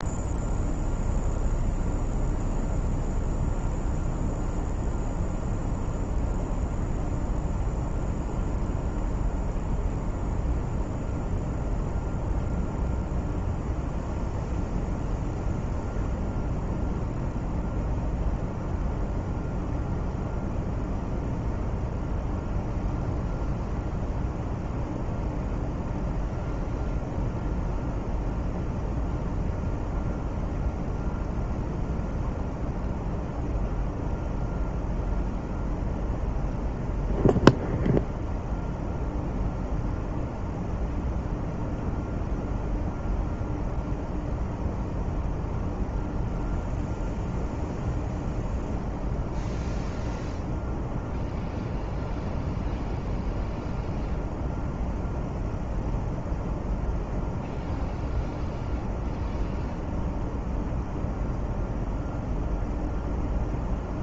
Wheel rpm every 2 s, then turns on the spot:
0, 0, 0, 0, 0, 0, 0, 0, 0, 0, 0, 0, 0, 0, 0, 0, 0, 0, 0, 0, 0, 0, 0, 0, 0, 0, 0, 0, 0, 0, 0, 0.
none